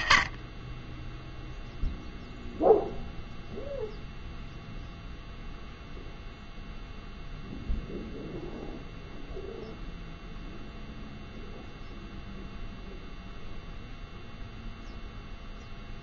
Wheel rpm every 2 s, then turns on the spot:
20, 0, 0, 0, 0, 0, 0, 0.
none